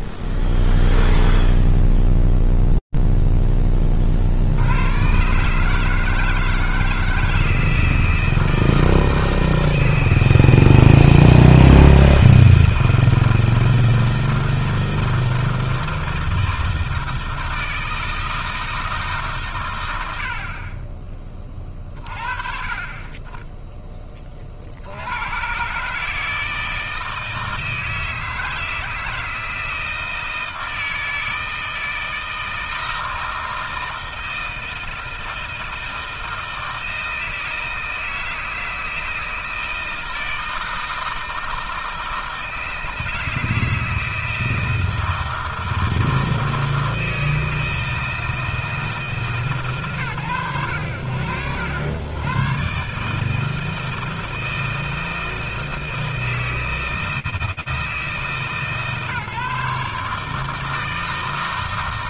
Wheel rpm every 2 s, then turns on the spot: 0, 0, 20, 150, 160, 160, 160, 160, 160, 160, 70, 30, 50, 160, 160, 160, 160, 160, 160, 160, 160, 160, 160, 160, 160, 70, 140, 160, 160, 140, 160.
none